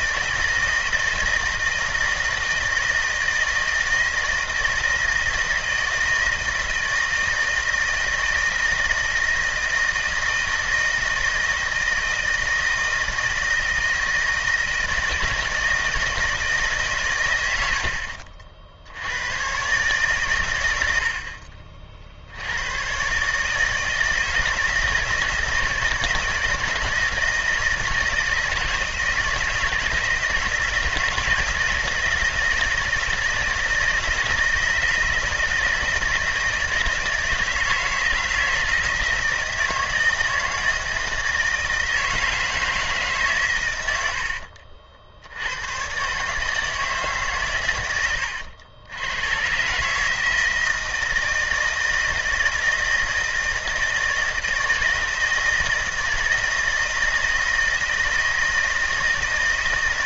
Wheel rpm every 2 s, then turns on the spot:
160, 160, 160, 160, 160, 160, 160, 160, 140, 80, 80, 120, 160, 160, 160, 170, 160, 160, 160, 160, 160, 150, 70, 150, 90, 160, 160, 160, 160, 160.
none